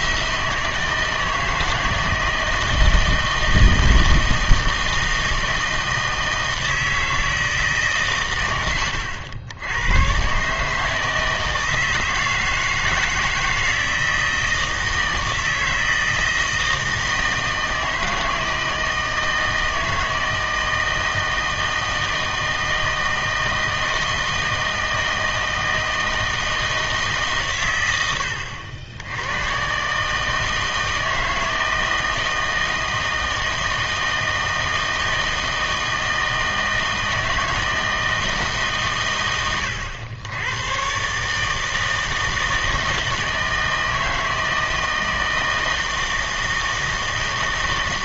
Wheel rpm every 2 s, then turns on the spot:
160, 160, 160, 160, 100, 150, 160, 160, 160, 160, 160, 160, 160, 160, 80, 160, 160, 160, 160, 150, 110, 160, 160, 160.
none